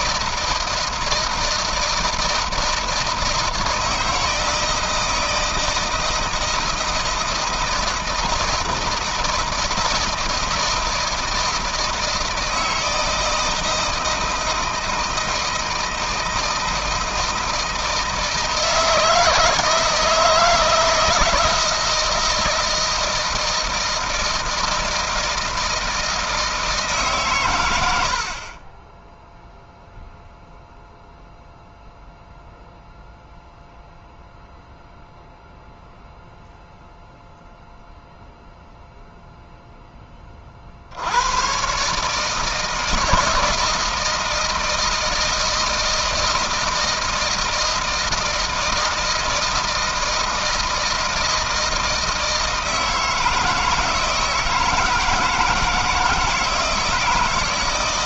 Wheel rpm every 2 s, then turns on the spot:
160, 160, 160, 160, 160, 160, 160, 160, 160, 160, 160, 160, 160, 160, 50, 0, 0, 0, 0, 0, 30, 150, 160, 160, 160, 160, 160, 160, 160.
none